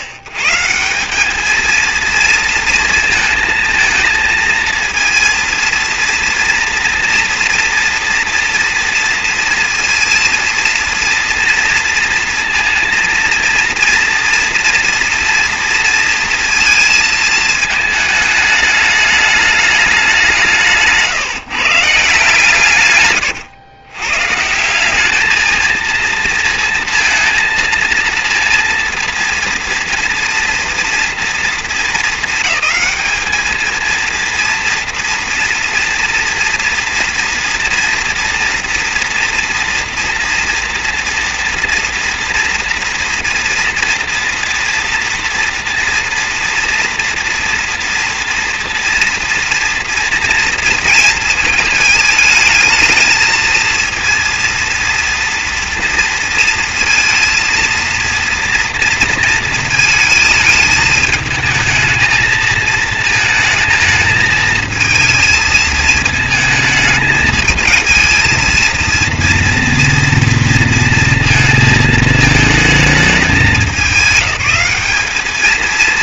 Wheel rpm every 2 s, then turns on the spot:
130, 230, 230, 230, 230, 230, 230, 230, 230, 210, 170, 150, 160, 230, 230, 230, 220, 230, 230, 240, 230, 230, 230, 240, 240, 230, 220, 240, 230, 230, 220, 220, 220, 220, 230, 230, 220, 210.
none